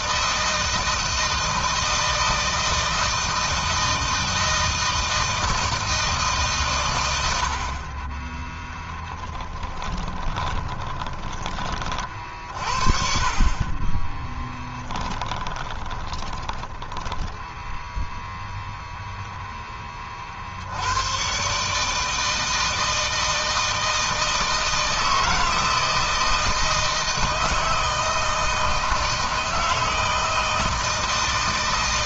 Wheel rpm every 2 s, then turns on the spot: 160, 160, 160, 140, 20, 20, 40, 10, 30, 0, 50, 160, 160, 160, 160, 160.
8-12 14-18